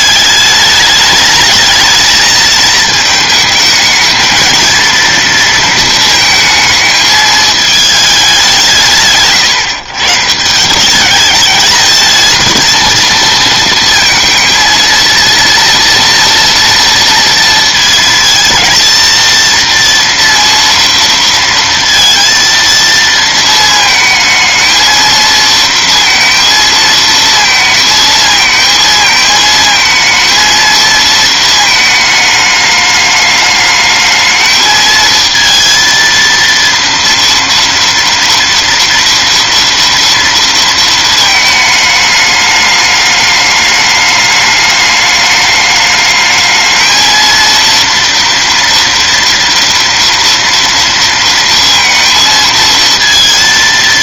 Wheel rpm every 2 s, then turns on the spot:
210, 220, 230, 220, 160, 190, 230, 230, 230, 230, 230, 230, 220, 230, 230, 230, 210, 220, 230, 230, 230, 210, 210, 220, 230, 230, 230.
none